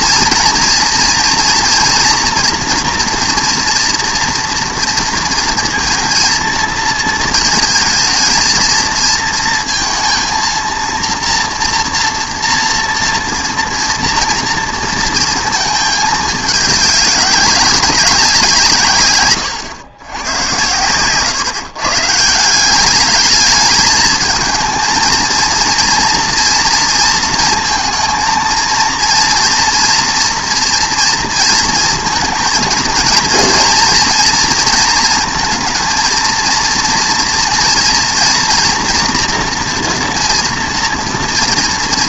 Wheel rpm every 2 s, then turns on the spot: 240, 240, 230, 230, 230, 230, 230, 230, 200, 150, 120, 190, 230, 230, 230, 230, 230, 230, 230, 230, 230.
none